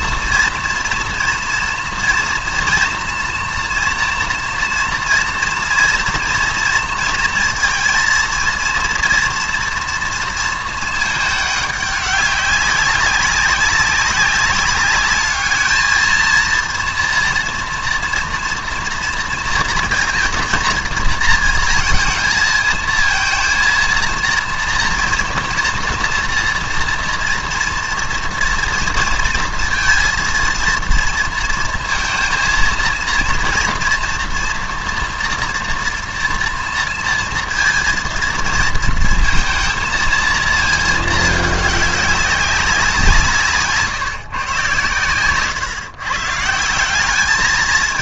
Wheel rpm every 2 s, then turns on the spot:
230, 230, 230, 230, 240, 230, 190, 200, 230, 230, 230, 220, 230, 230, 230, 230, 230, 230, 230, 230, 220, 190, 130, 170.
none